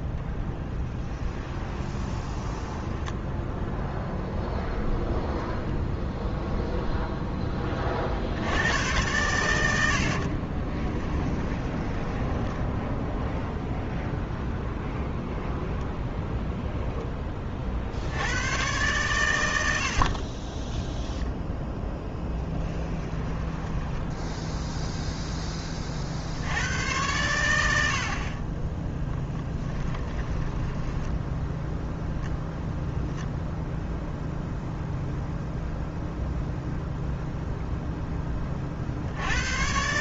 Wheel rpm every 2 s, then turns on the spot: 10, 10, 0, 0, 100, 20, 10, 0, 0, 120, 10, 20, 0, 100, 10, 10, 0, 0, 0, 50.
0-4 10-14 20-24 28-32